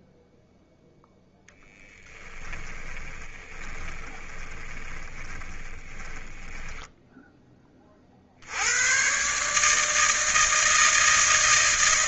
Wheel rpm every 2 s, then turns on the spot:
0, 30, 30, 20, 90, 160.
2-8